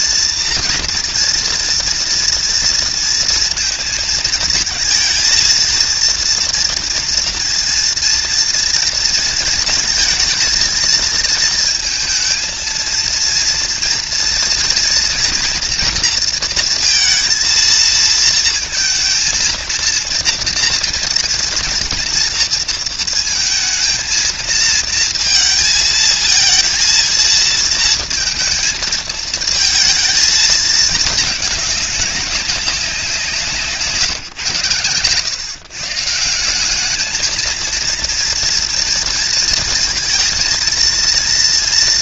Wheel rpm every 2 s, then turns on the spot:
230, 230, 220, 230, 230, 230, 220, 240, 230, 230, 230, 230, 230, 230, 230, 220, 200, 130, 190, 230, 230.
none